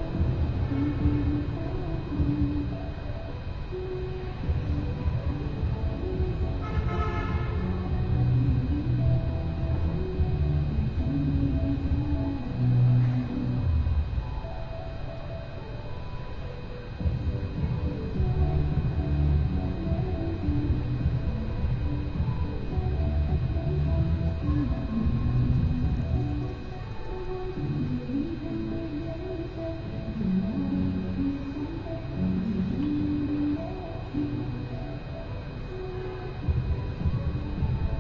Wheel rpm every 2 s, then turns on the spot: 0, 0, 0, 0, 0, 0, 0, 0, 0, 0, 0, 0, 0, 0, 0, 0, 0, 0, 0.
none